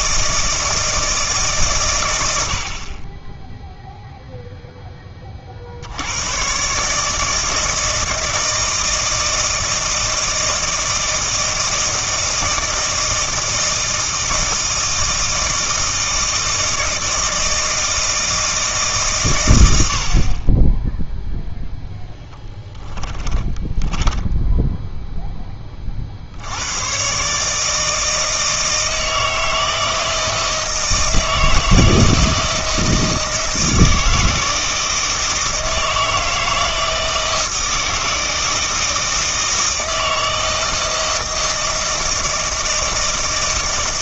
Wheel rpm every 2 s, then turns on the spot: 160, 60, 10, 140, 160, 160, 160, 160, 160, 150, 10, 10, 0, 120, 160, 160, 160, 160, 160, 160, 160, 160.
22-24